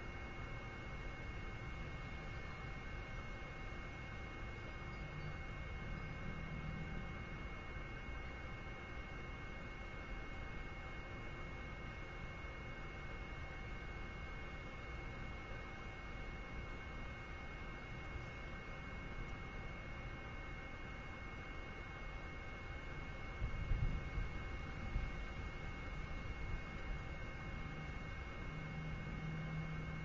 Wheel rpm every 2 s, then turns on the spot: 0, 0, 0, 0, 0, 0, 0, 0, 0, 0, 0, 0, 0, 0, 0.
none